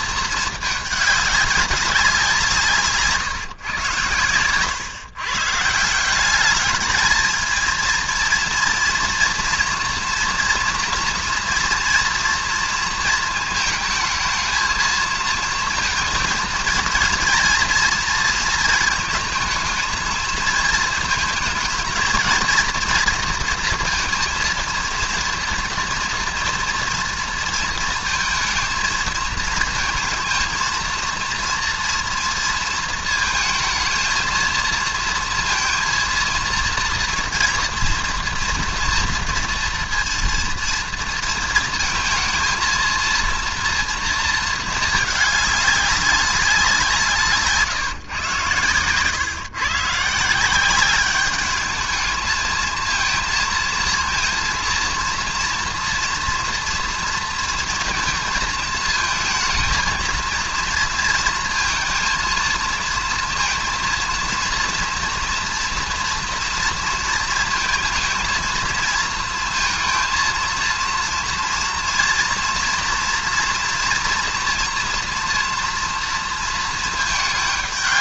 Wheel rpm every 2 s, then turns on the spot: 220, 170, 110, 210, 230, 230, 230, 220, 230, 230, 220, 230, 230, 230, 230, 230, 230, 230, 230, 240, 230, 220, 220, 190, 120, 180, 220, 230, 230, 220, 230, 230, 230, 230, 230, 230, 230, 240, 230.
none